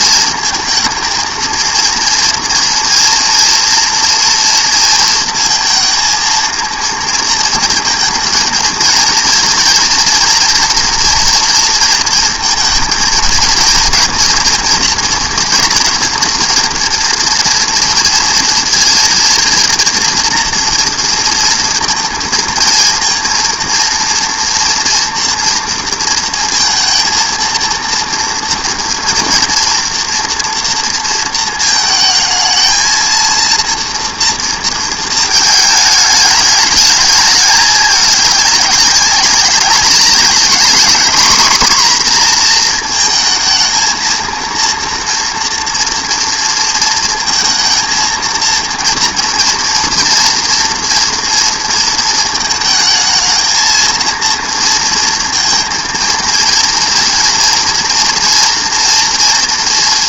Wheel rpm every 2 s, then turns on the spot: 230, 230, 230, 230, 220, 240, 230, 230, 230, 220, 230, 230, 230, 230, 230, 230, 220, 230, 210, 200, 210, 240, 230, 230, 230, 230, 220, 230, 230, 230.
none